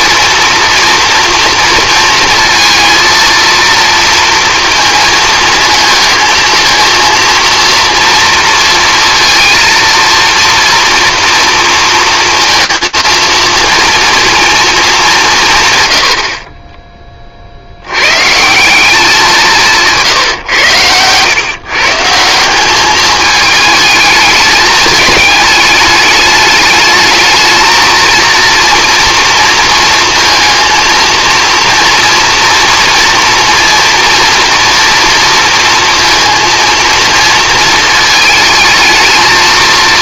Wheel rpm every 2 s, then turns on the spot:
240, 230, 230, 230, 230, 240, 230, 220, 30, 190, 110, 200, 220, 220, 230, 230, 240, 230, 230, 220.
none